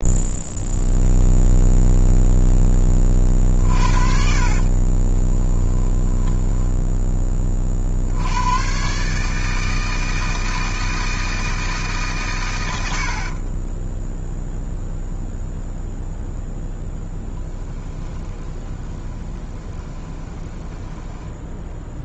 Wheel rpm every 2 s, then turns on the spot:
0, 20, 40, 10, 130, 160, 90, 0, 0, 20, 10.
4-6 12-14 18-22